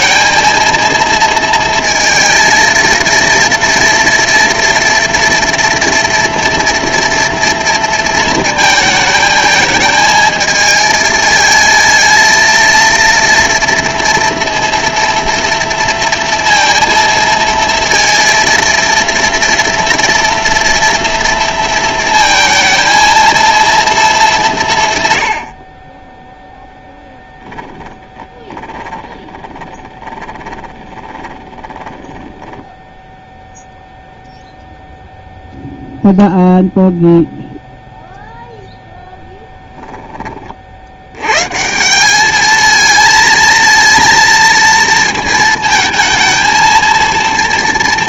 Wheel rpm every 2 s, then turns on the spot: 230, 230, 240, 240, 220, 220, 230, 230, 230, 230, 230, 230, 160, 0, 20, 20, 10, 0, 0, 0, 60, 220, 230, 230.
28-32